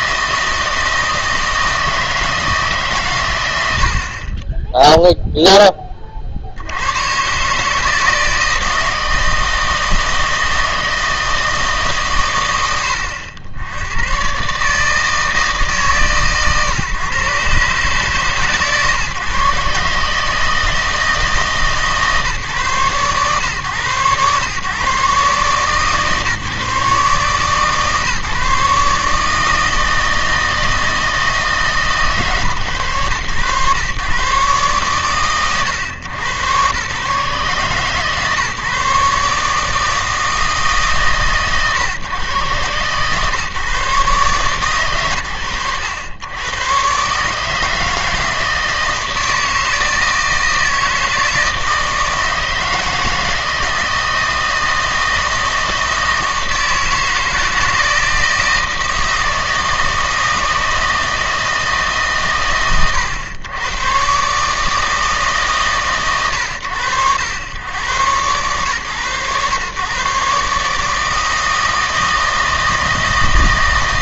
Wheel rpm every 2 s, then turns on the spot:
160, 150, 10, 100, 160, 160, 80, 140, 130, 130, 160, 140, 130, 140, 150, 160, 130, 140, 120, 150, 150, 120, 130, 120, 160, 160, 160, 160, 160, 160, 160, 90, 160, 90, 120, 150, 160.
none